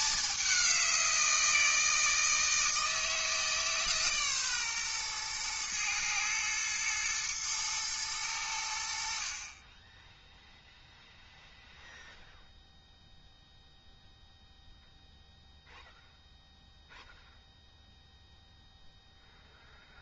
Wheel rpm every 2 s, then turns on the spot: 200, 160, 130, 110, 90, 0, 0, 0, 0, 0.
none